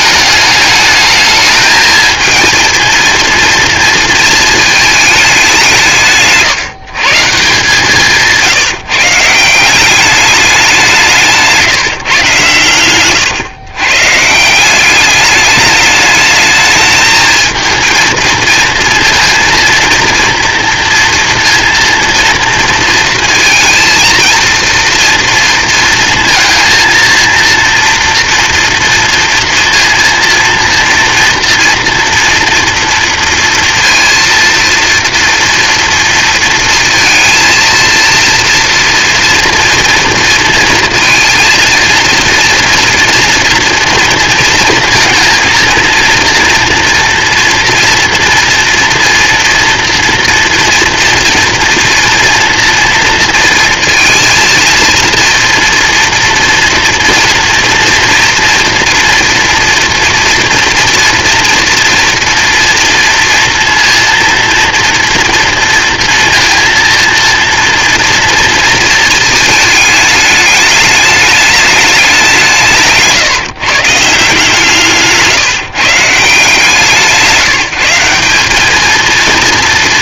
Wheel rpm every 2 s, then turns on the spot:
210, 220, 220, 160, 160, 190, 110, 180, 220, 230, 230, 230, 230, 220, 240, 230, 230, 230, 230, 230, 230, 240, 230, 230, 230, 230, 230, 230, 230, 230, 240, 240, 230, 230, 220, 220, 160, 150, 160, 210.
none